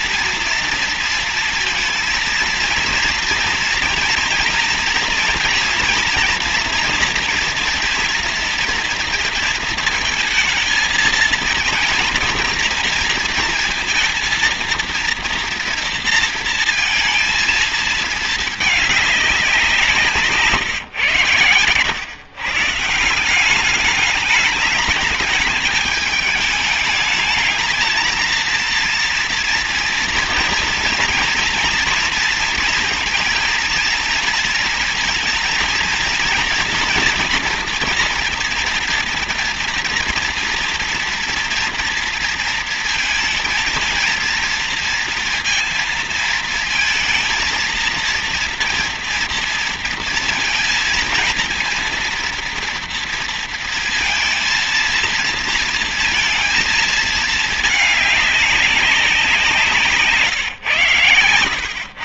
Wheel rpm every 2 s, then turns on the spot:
230, 230, 230, 240, 230, 230, 230, 230, 230, 220, 130, 140, 210, 210, 230, 230, 230, 230, 230, 230, 230, 230, 230, 230, 230, 230, 240, 230, 230, 200, 140.
none